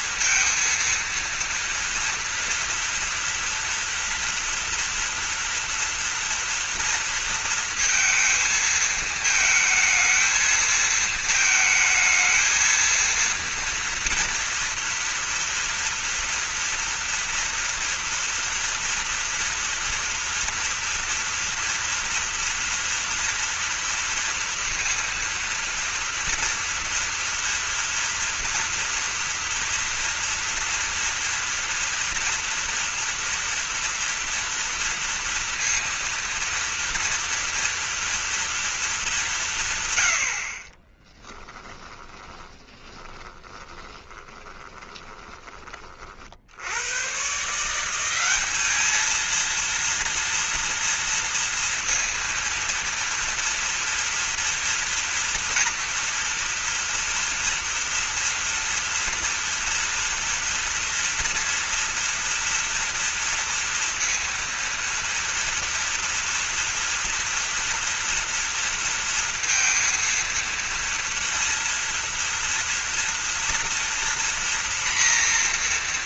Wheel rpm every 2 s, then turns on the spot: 230, 230, 240, 230, 220, 230, 230, 230, 230, 240, 230, 240, 230, 240, 230, 230, 230, 230, 230, 210, 20, 20, 20, 110, 210, 230, 230, 230, 230, 230, 230, 230, 230, 230, 230, 230, 230, 240.
40-46